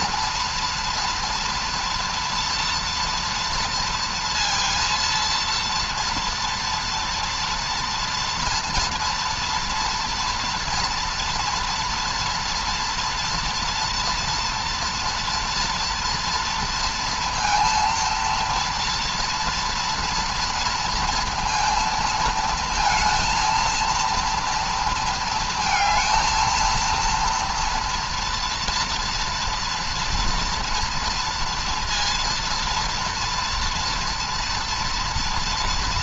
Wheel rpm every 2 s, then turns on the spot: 230, 230, 230, 230, 230, 230, 230, 240, 230, 230, 230, 230, 230, 230, 230, 240, 230, 230.
none